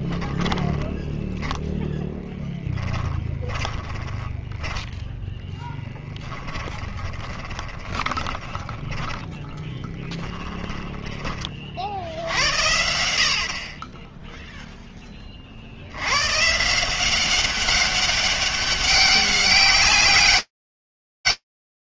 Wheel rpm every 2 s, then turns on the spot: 20, 10, 20, 10, 20, 10, 70, 0, 150, 200, 200.
0-12